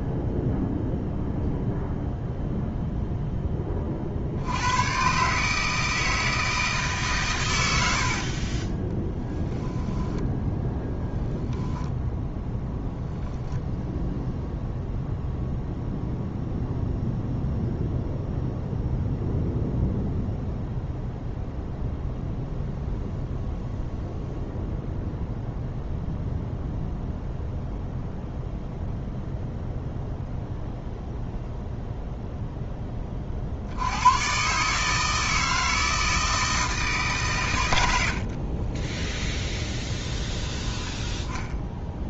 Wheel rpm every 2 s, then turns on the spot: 0, 0, 110, 150, 20, 10, 0, 0, 0, 0, 0, 0, 0, 0, 0, 0, 10, 150, 150, 10, 10.
8-10 38-40